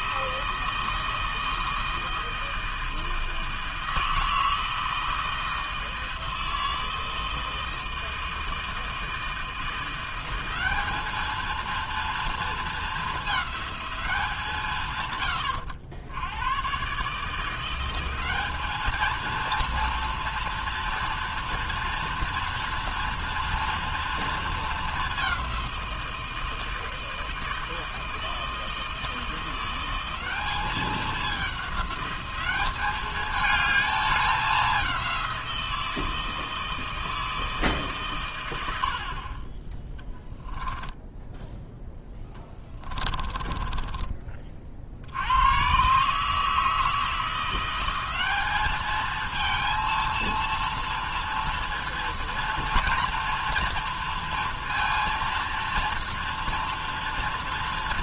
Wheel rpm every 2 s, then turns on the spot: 160, 160, 160, 160, 160, 200, 220, 130, 130, 220, 230, 230, 210, 160, 160, 200, 210, 190, 160, 60, 10, 20, 70, 160, 220, 230, 230, 230, 230.
40-44